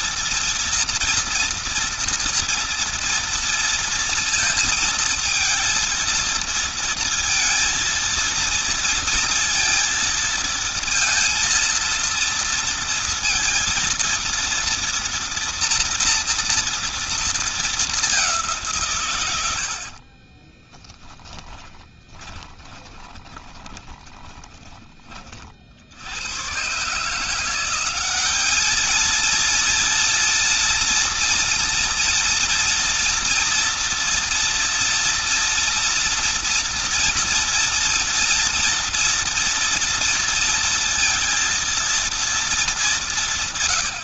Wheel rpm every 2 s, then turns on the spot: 230, 230, 230, 230, 230, 230, 230, 230, 230, 140, 30, 10, 40, 150, 220, 230, 230, 230, 230, 230, 230, 200.
20-24